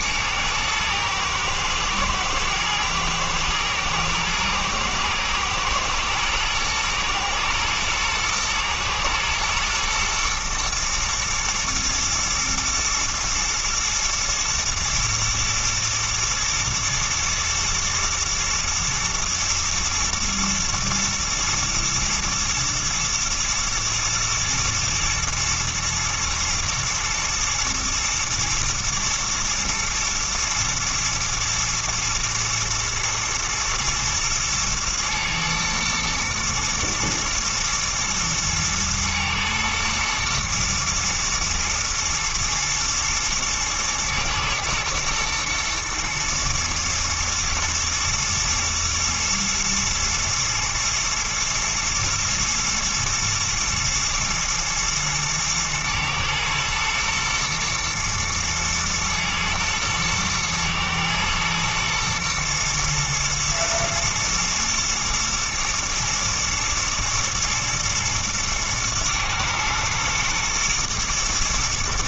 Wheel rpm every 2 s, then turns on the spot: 110, 110, 110, 120, 120, 120, 110, 120, 110, 110, 110, 120, 120, 110, 110, 110, 120, 110, 120, 110, 110, 110, 110, 120, 120, 120, 110, 120, 110, 110, 110, 120, 120, 120, 110, 110.
none